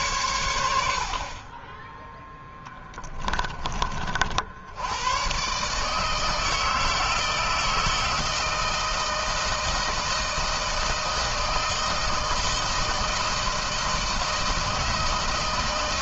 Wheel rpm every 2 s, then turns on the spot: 100, 10, 80, 160, 160, 160, 160, 160.
2-4